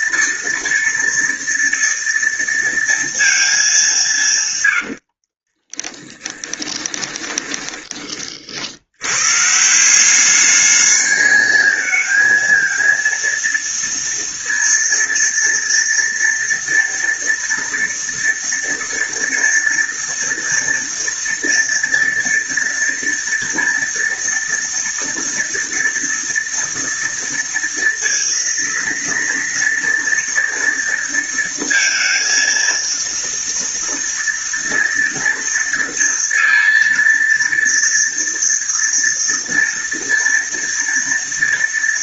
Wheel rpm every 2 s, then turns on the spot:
230, 230, 150, 20, 50, 210, 230, 230, 230, 230, 230, 230, 230, 230, 230, 230, 230, 230, 230, 240, 240.
6-8